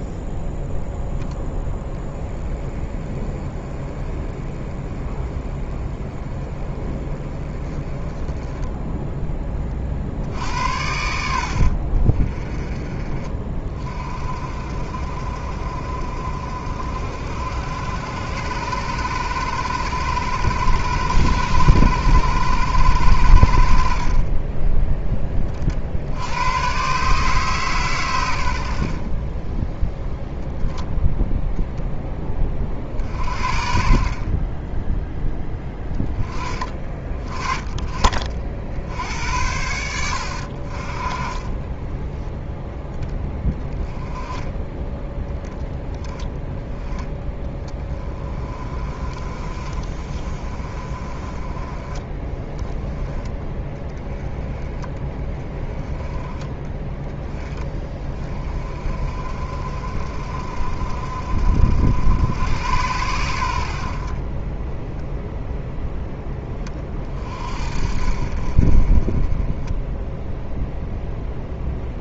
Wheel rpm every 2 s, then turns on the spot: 0, 20, 20, 20, 10, 80, 30, 50, 60, 100, 100, 100, 20, 130, 60, 0, 40, 10, 20, 60, 40, 10, 10, 10, 30, 30, 20, 20, 20, 40, 50, 90, 10, 30, 30, 0.
none